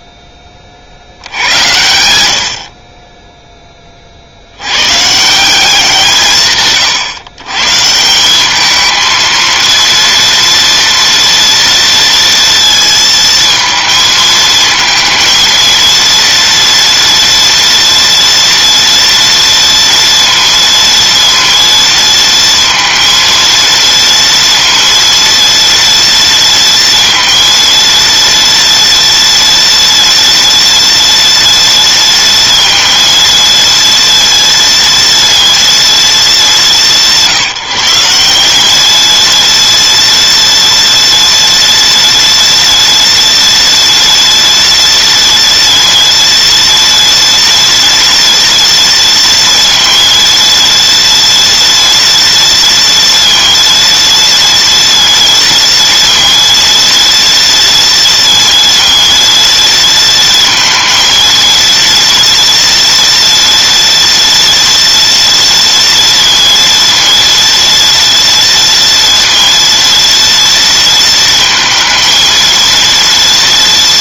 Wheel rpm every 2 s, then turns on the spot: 60, 20, 130, 140, 220, 230, 230, 220, 240, 230, 230, 230, 230, 230, 230, 230, 230, 230, 180, 220, 240, 230, 230, 230, 230, 230, 230, 230, 230, 230, 230, 230, 230, 230, 230, 230, 230.
none